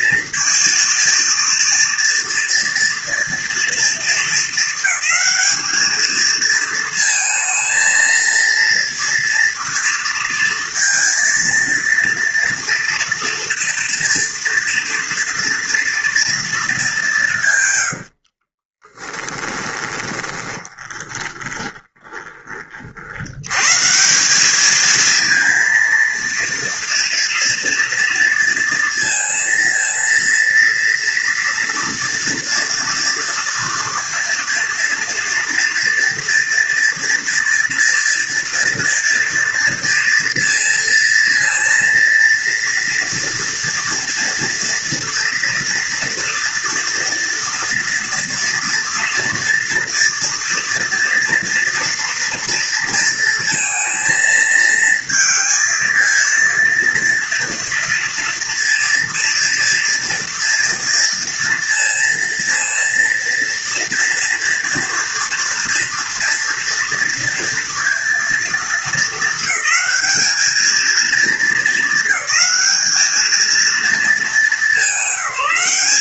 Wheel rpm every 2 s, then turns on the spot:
230, 230, 220, 220, 230, 230, 240, 230, 220, 40, 20, 40, 220, 230, 230, 230, 230, 230, 240, 230, 230, 230, 230, 230, 230, 230, 230, 230, 230, 230, 230, 230, 230, 230, 230, 220, 210, 210.
18-22